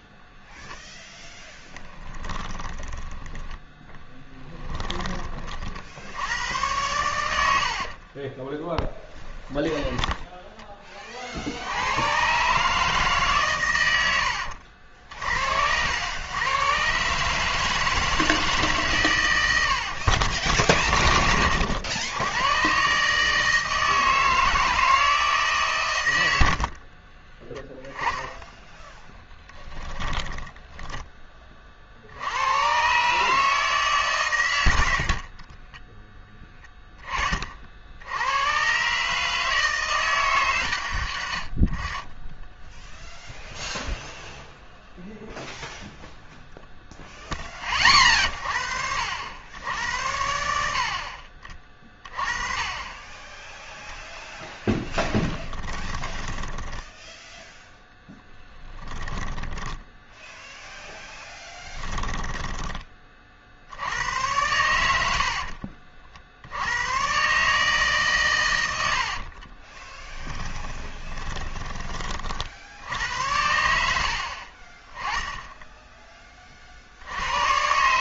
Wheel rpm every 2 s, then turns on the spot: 0, 20, 20, 100, 10, 20, 150, 70, 130, 140, 70, 140, 160, 40, 10, 10, 120, 90, 20, 130, 110, 10, 0, 0, 60, 70, 20, 10, 10, 10, 0, 20, 80, 110, 80, 10, 70, 20, 60.
2-6 8-10 26-32 54-60 68-72